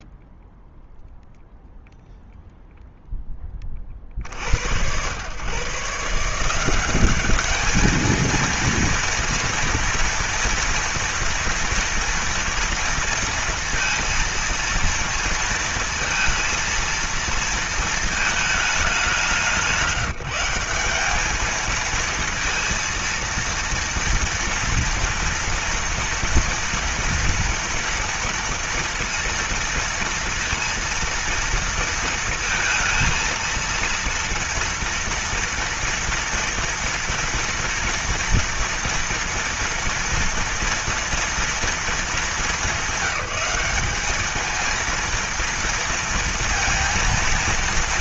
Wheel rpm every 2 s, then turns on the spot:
0, 0, 80, 180, 230, 230, 230, 230, 230, 210, 200, 230, 230, 230, 230, 230, 230, 230, 230, 230, 240, 200, 230, 230.
none